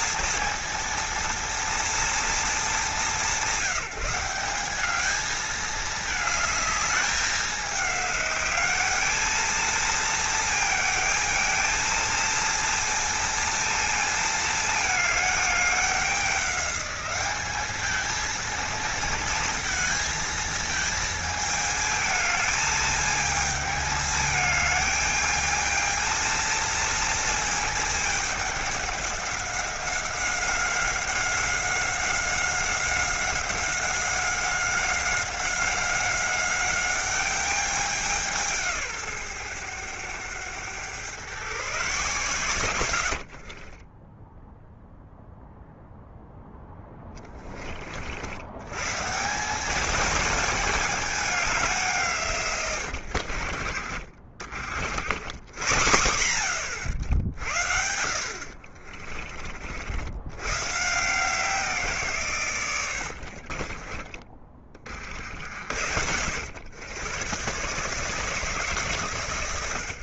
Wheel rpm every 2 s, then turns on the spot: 230, 210, 200, 210, 210, 220, 230, 220, 200, 230, 220, 220, 210, 230, 200, 190, 190, 190, 200, 150, 110, 110, 0, 10, 120, 220, 120, 70, 80, 50, 140, 100, 40, 110, 140.
42-44 46-48 52-54 58-60 62-64